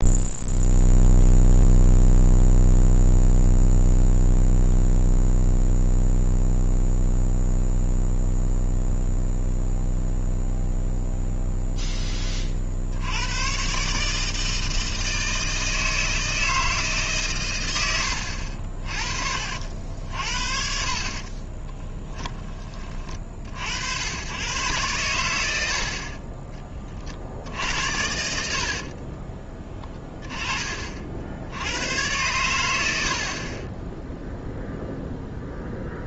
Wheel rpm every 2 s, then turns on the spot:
0, 0, 0, 0, 0, 0, 40, 160, 160, 60, 50, 20, 120, 30, 60, 20, 90, 0.
18-20